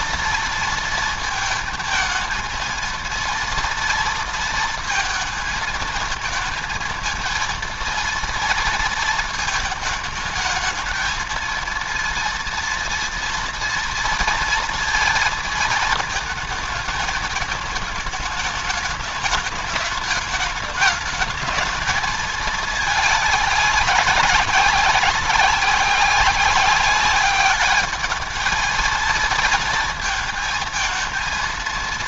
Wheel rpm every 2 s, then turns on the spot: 230, 230, 230, 230, 230, 220, 230, 230, 210, 210, 220, 220, 190, 200, 220, 220.
none